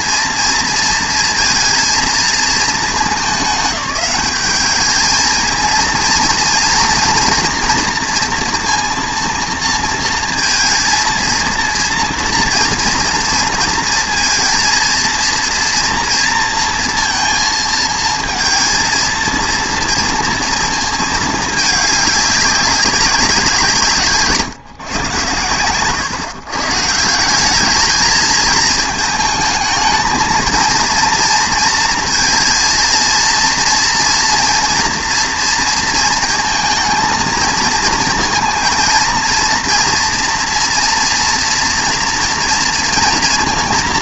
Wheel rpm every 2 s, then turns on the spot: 230, 220, 210, 240, 230, 230, 240, 230, 230, 230, 230, 200, 130, 150, 220, 230, 230, 230, 220, 230, 230, 230.
none